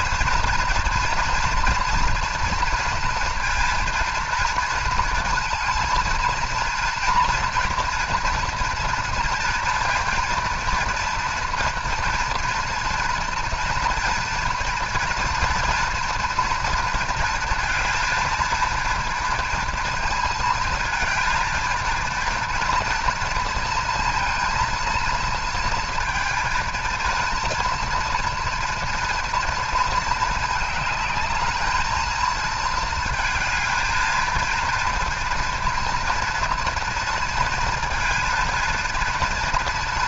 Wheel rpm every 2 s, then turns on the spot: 230, 230, 220, 230, 230, 230, 230, 230, 230, 230, 230, 230, 230, 220, 230, 210, 230, 230, 230, 230.
none